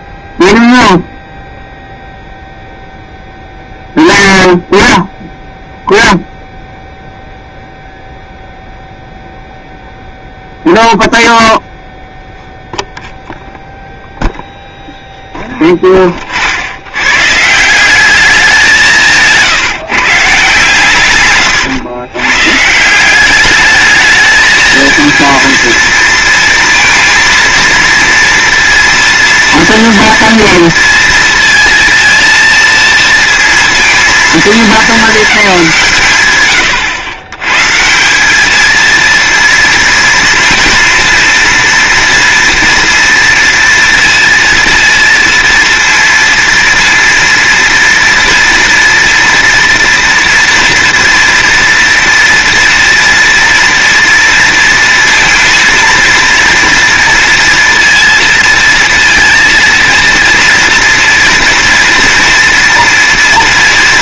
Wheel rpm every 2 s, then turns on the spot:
0, 0, 0, 0, 0, 0, 0, 0, 70, 190, 140, 150, 220, 230, 230, 230, 230, 220, 110, 220, 230, 230, 230, 230, 230, 240, 230, 230, 230, 230, 230, 240.
none